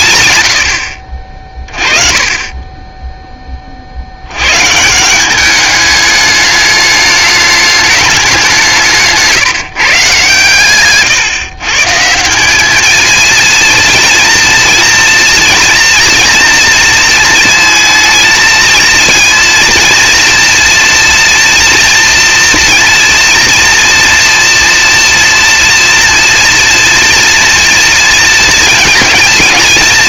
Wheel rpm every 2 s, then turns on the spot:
50, 10, 170, 210, 160, 130, 220, 240, 230, 230, 230, 230, 230, 230, 220.
none